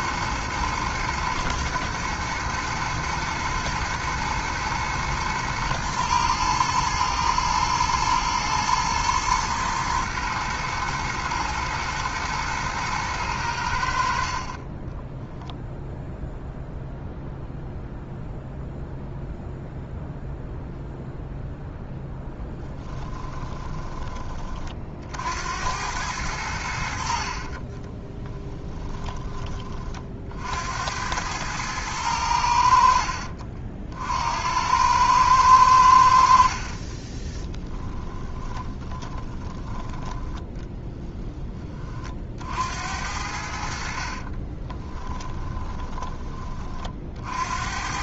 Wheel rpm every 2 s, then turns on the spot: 110, 110, 120, 110, 120, 110, 110, 20, 0, 0, 0, 10, 50, 60, 10, 80, 60, 100, 30, 20, 10, 70, 20, 50.
22-24 36-40 44-46